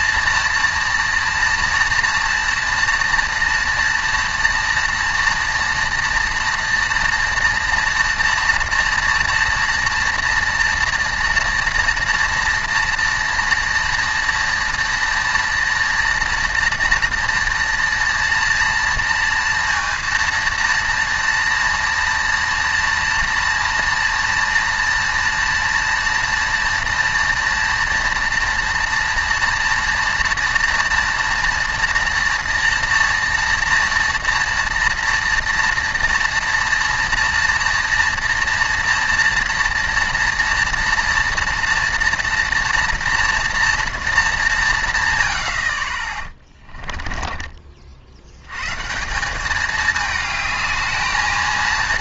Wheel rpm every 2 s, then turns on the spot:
230, 230, 230, 230, 230, 230, 230, 230, 230, 230, 230, 230, 230, 230, 230, 230, 230, 230, 230, 230, 230, 230, 200, 30, 100, 210.
46-48